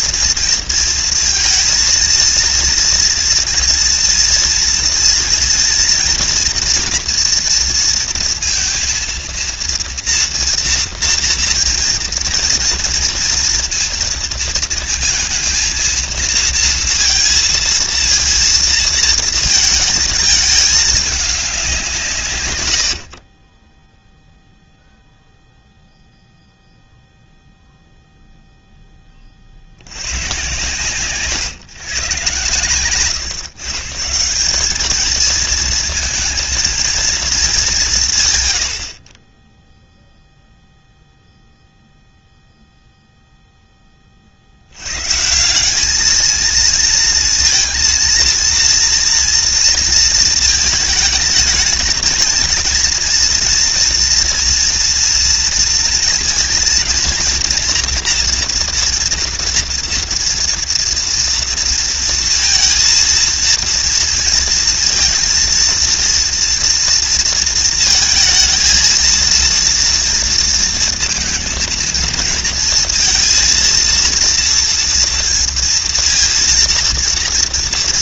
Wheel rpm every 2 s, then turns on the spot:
230, 230, 230, 230, 230, 230, 230, 230, 230, 230, 210, 90, 0, 0, 10, 130, 120, 220, 230, 50, 0, 0, 140, 230, 230, 220, 230, 230, 230, 230, 230, 230, 230, 230, 230, 230, 230, 230, 230.
22-24